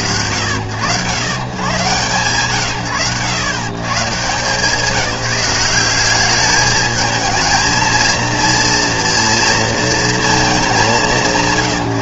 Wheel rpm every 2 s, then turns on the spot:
90, 90, 190, 220, 230, 180.
none